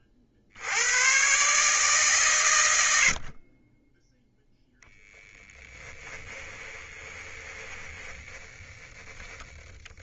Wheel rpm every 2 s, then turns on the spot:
80, 150, 0, 20, 10.
6-8